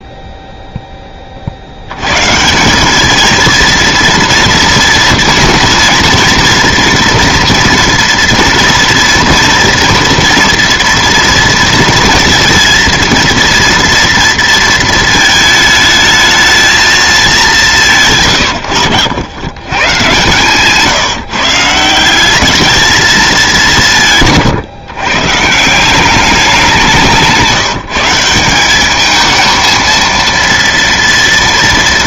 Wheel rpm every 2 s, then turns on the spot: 10, 190, 230, 240, 230, 230, 230, 230, 220, 90, 140, 210, 130, 190, 190, 230.
none